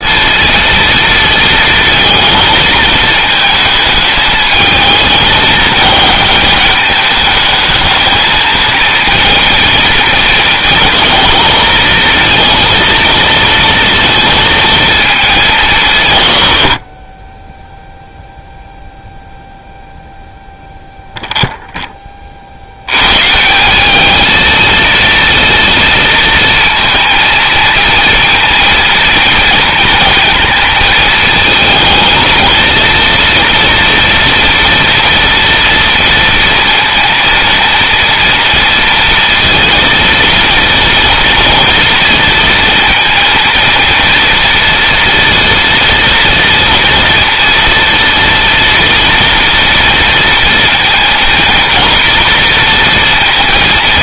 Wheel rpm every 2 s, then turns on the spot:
230, 220, 220, 210, 230, 230, 230, 220, 50, 0, 0, 110, 230, 230, 230, 220, 230, 230, 230, 230, 230, 230, 230, 230, 230, 230, 230.
none